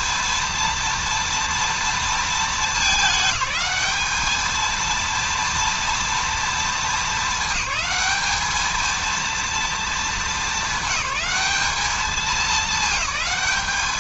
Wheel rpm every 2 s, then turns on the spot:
230, 210, 220, 230, 220, 200, 200.
none